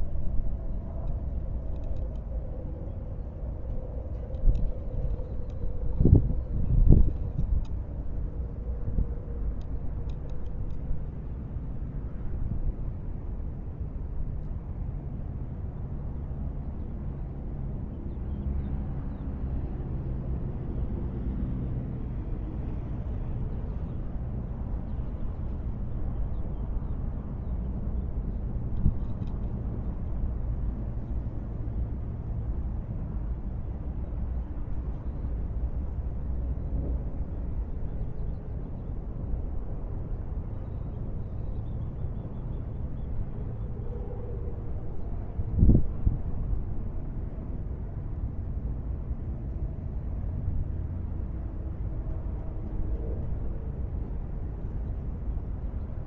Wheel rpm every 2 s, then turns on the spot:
0, 0, 0, 0, 0, 0, 0, 0, 0, 0, 0, 0, 0, 0, 0, 0, 0, 0, 0, 0, 0, 0, 0, 0, 0, 0, 0, 0.
none